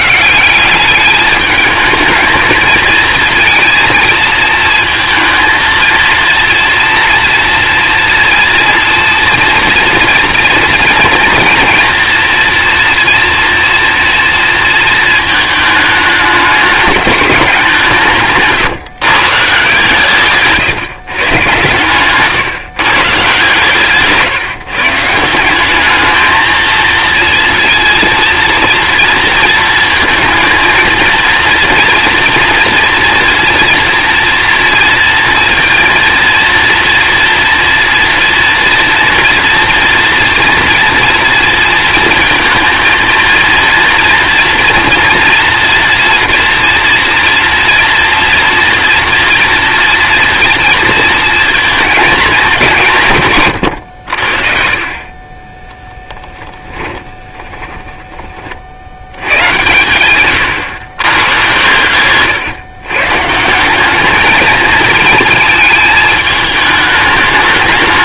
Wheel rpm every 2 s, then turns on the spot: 200, 220, 230, 240, 230, 240, 240, 230, 210, 150, 150, 140, 150, 220, 230, 230, 230, 230, 230, 230, 230, 230, 230, 230, 230, 230, 180, 40, 10, 70, 120, 130, 220, 210.
56-58